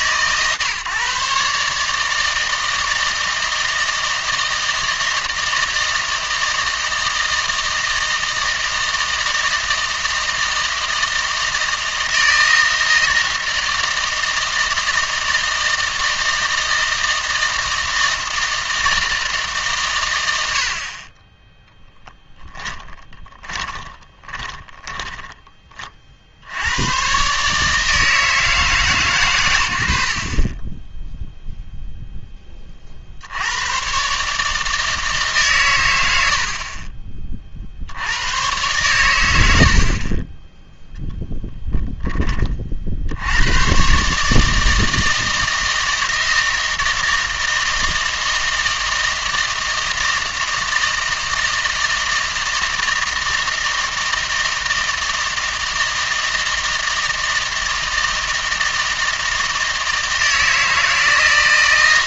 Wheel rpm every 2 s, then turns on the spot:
140, 160, 160, 160, 160, 160, 160, 160, 160, 160, 70, 10, 20, 80, 150, 30, 20, 150, 50, 110, 10, 50, 160, 160, 160, 160, 160, 160, 160, 160, 160.
22-26